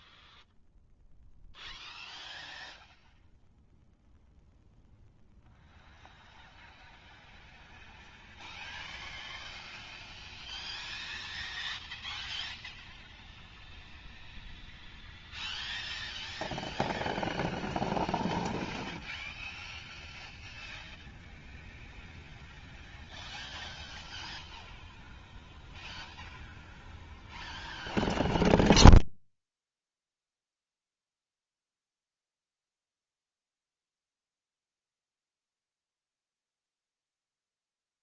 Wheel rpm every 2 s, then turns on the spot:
150, 0, 20, 0, 0, 0, 0, 0, 0, 0, 0, 0, 0, 0, 0, 0, 0, 0, 0.
none